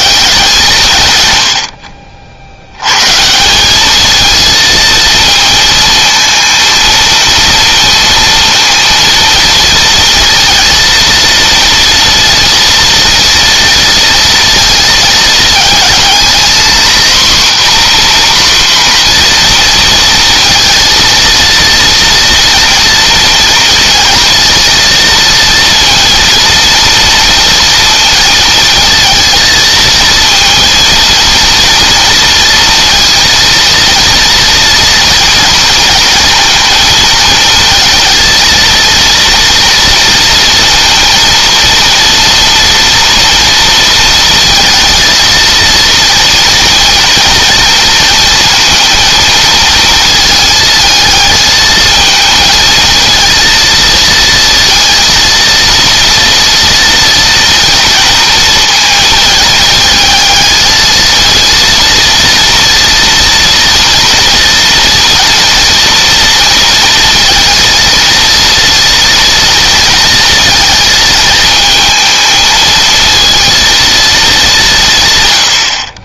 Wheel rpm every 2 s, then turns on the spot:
180, 90, 220, 230, 230, 230, 230, 230, 240, 250, 230, 230, 230, 230, 230, 230, 230, 230, 230, 220, 230, 230, 230, 230, 230, 220, 230, 230, 230, 230, 220, 230, 230, 230, 230, 230, 220, 180.
none